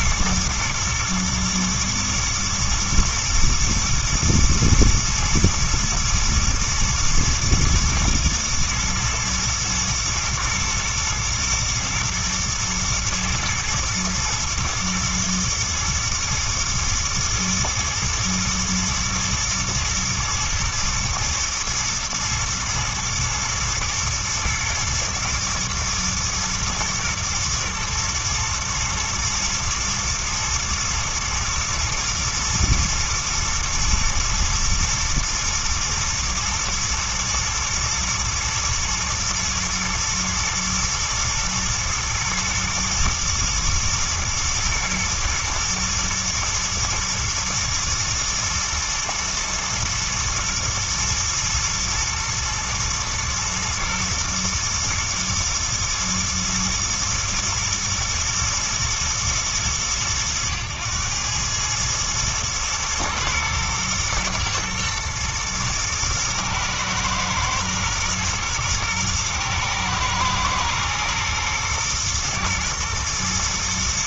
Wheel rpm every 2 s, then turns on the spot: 120, 110, 120, 120, 120, 120, 110, 120, 110, 110, 110, 110, 110, 120, 120, 120, 110, 110, 110, 110, 110, 120, 120, 120, 110, 110, 120, 110, 120, 110, 100, 110, 110, 110, 110, 110, 110.
none